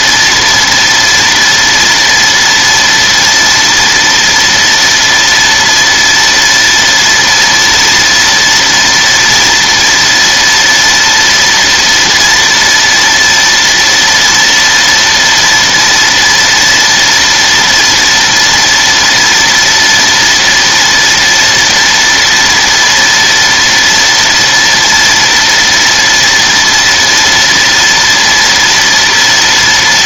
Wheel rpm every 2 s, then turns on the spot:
230, 230, 230, 230, 230, 230, 230, 230, 230, 230, 230, 230, 230, 230, 230.
none